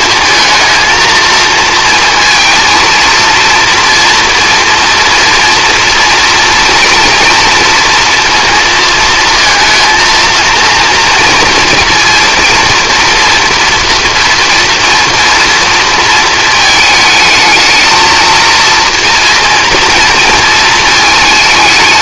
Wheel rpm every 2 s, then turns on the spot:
220, 230, 240, 240, 230, 230, 240, 230, 220, 230, 220.
none